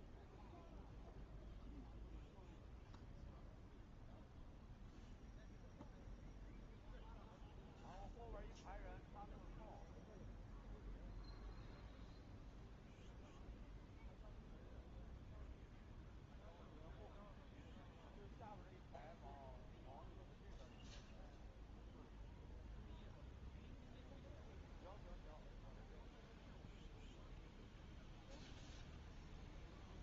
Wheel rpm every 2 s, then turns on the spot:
0, 0, 0, 0, 0, 0, 0, 0, 0, 0, 0, 0, 0, 0, 0.
none